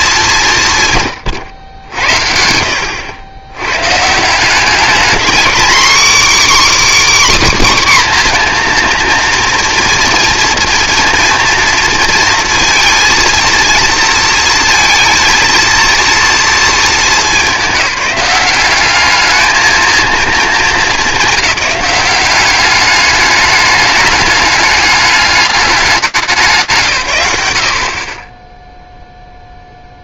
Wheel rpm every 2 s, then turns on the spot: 160, 80, 200, 300, 240, 230, 230, 230, 230, 200, 210, 200, 210, 170, 0.
none